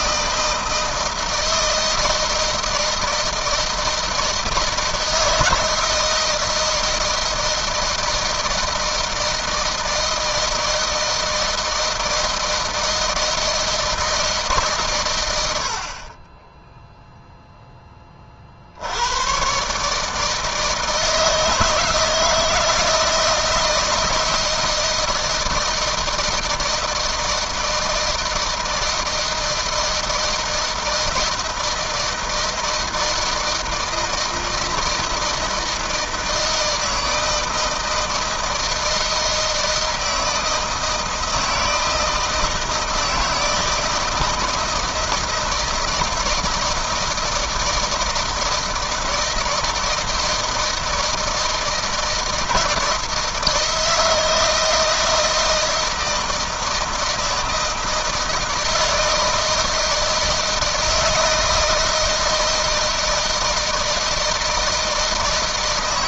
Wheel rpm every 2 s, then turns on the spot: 160, 160, 160, 160, 160, 160, 160, 110, 0, 80, 160, 160, 160, 160, 160, 160, 160, 160, 160, 160, 160, 160, 160, 160, 160, 160, 170, 160, 160, 160, 160, 160, 160.
none